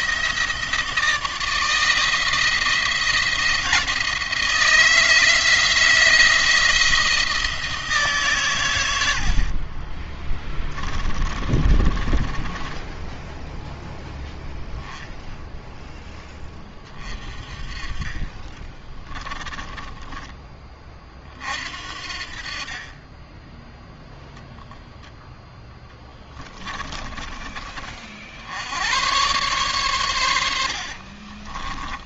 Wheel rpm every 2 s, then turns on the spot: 160, 170, 160, 160, 120, 20, 10, 0, 20, 20, 30, 30, 0, 20, 80, 70.
10-14 18-20 26-28 30-32